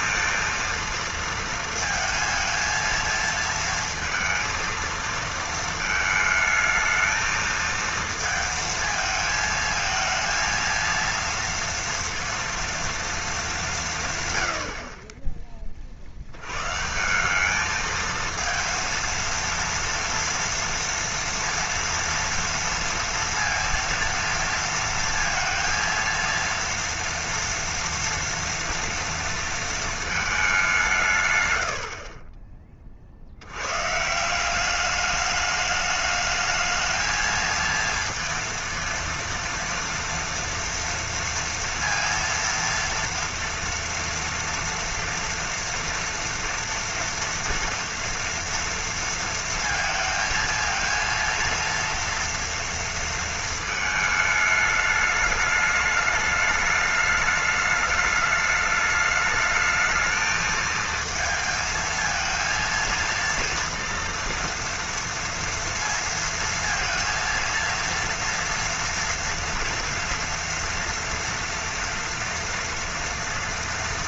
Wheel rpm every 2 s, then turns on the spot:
230, 230, 230, 220, 220, 230, 230, 70, 130, 230, 230, 230, 230, 230, 230, 180, 20, 200, 220, 230, 230, 230, 230, 230, 230, 230, 230, 210, 210, 210, 220, 230, 230, 230, 230, 230, 240.
none